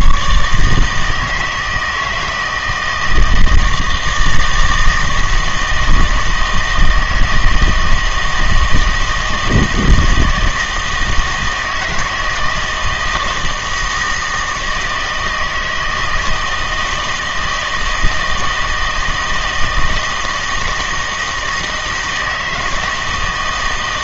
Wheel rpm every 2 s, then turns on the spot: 150, 160, 160, 160, 160, 160, 160, 160, 160, 160, 160, 160.
none